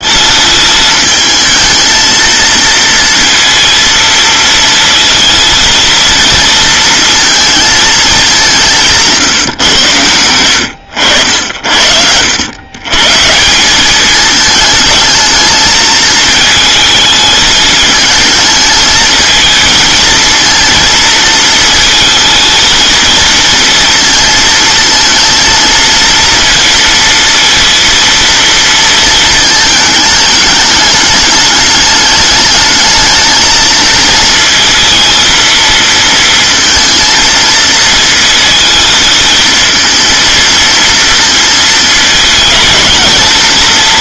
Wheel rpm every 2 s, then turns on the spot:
220, 230, 230, 230, 170, 90, 120, 220, 220, 220, 230, 220, 230, 230, 230, 210, 220, 230, 230, 220, 230, 220.
none